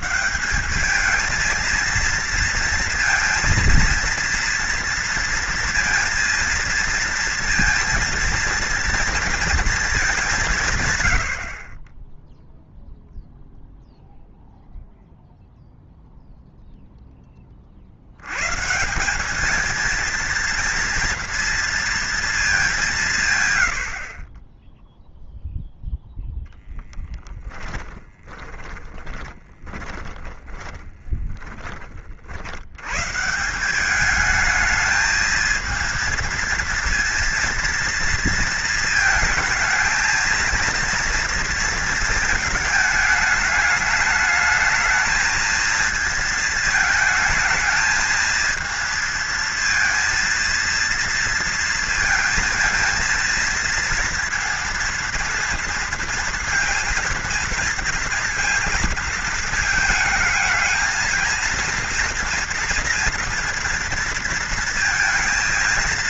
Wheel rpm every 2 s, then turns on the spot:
190, 230, 230, 230, 230, 160, 0, 0, 0, 150, 230, 210, 20, 10, 20, 30, 90, 210, 230, 230, 230, 220, 220, 220, 220, 230, 220, 230, 230, 230, 220, 230, 230.
26-32